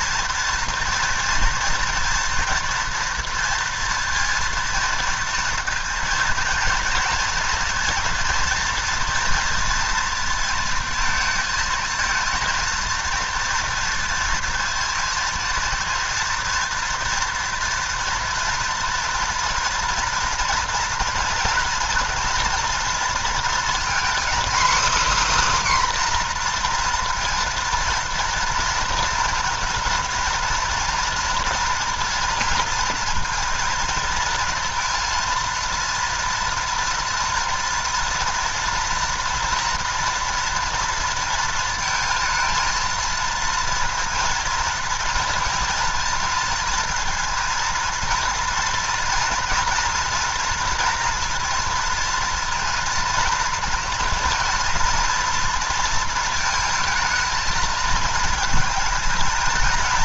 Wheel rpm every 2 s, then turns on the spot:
230, 230, 230, 230, 230, 230, 230, 230, 230, 230, 240, 230, 280, 240, 230, 230, 230, 230, 230, 230, 230, 230, 230, 230, 230, 230, 230, 240, 230, 230.
none